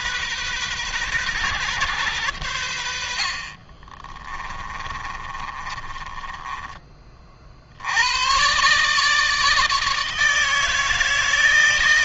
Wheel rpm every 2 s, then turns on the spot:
120, 80, 20, 30, 140, 160.
4-6